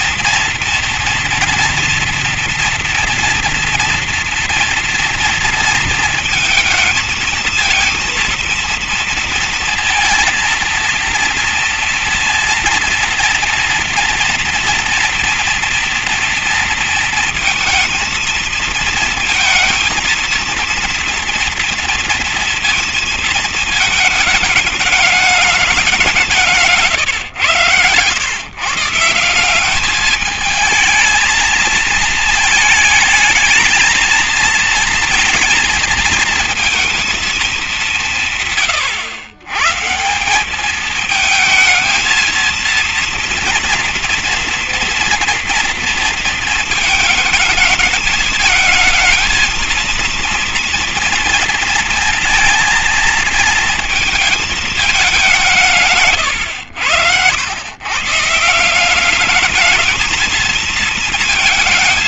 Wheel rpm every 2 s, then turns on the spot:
240, 230, 230, 220, 230, 230, 230, 230, 230, 230, 230, 230, 210, 170, 140, 220, 220, 230, 230, 140, 200, 230, 230, 220, 220, 230, 230, 220, 110, 170, 230.
none